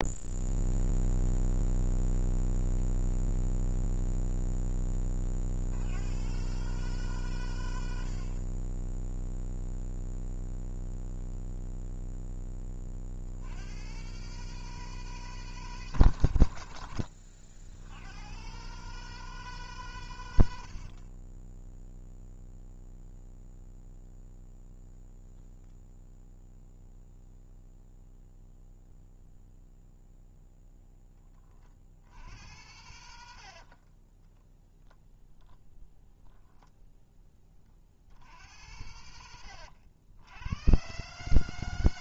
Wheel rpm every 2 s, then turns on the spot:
0, 0, 30, 140, 10, 0, 50, 160, 100, 150, 40, 0, 0, 0, 0, 10, 90, 0, 10, 80, 130.
8-10 20-22